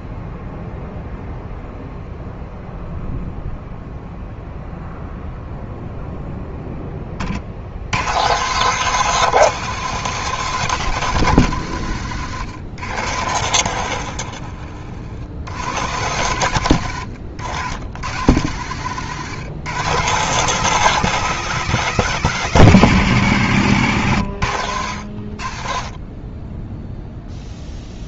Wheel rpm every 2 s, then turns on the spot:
0, 0, 0, 10, 150, 170, 100, 50, 110, 120, 160, 140, 90, 10.
none